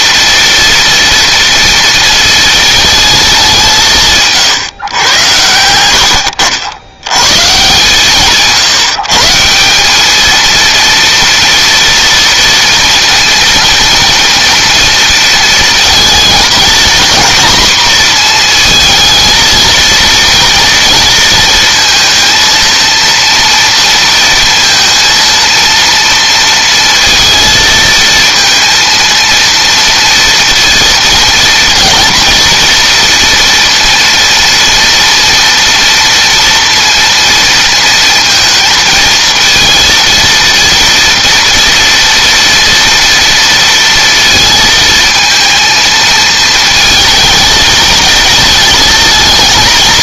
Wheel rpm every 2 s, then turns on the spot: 230, 210, 120, 110, 150, 230, 230, 230, 230, 220, 230, 230, 230, 230, 230, 230, 240, 230, 230, 230, 230, 230, 230, 220, 220.
none